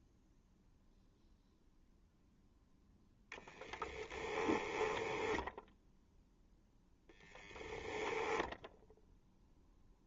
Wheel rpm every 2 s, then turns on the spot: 0, 0, 10, 0, 0.
4-6